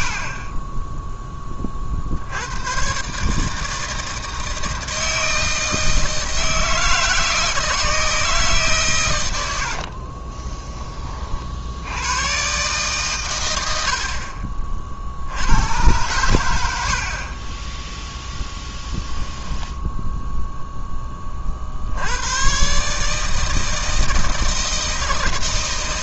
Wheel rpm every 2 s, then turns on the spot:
10, 120, 160, 160, 120, 20, 130, 60, 70, 0, 10, 140, 160.
none